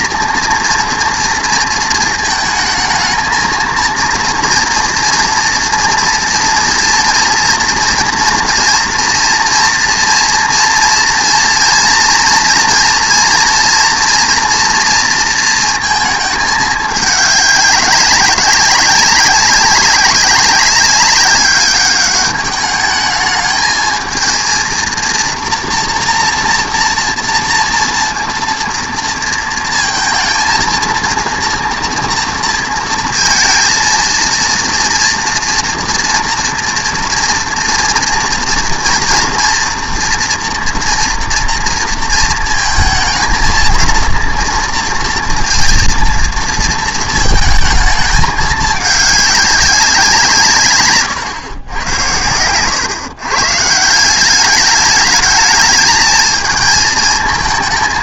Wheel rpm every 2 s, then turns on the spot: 230, 220, 230, 230, 230, 230, 240, 230, 210, 200, 200, 210, 230, 230, 230, 230, 230, 230, 240, 230, 230, 230, 230, 230, 210, 140, 120, 210, 220.
none